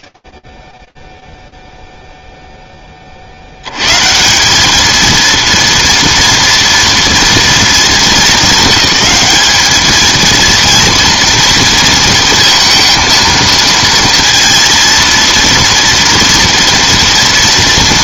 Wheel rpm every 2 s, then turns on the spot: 20, 10, 190, 230, 200, 230, 230, 230, 230.
none